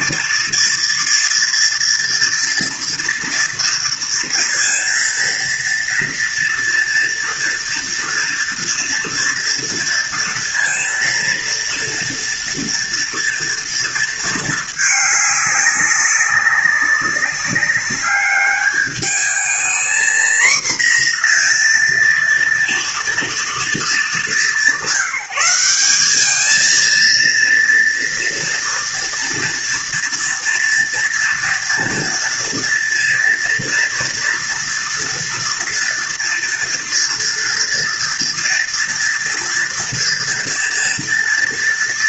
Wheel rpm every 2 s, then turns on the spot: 230, 230, 230, 230, 230, 230, 230, 220, 200, 210, 240, 230, 190, 230, 230, 230, 230, 230, 230, 230, 230.
none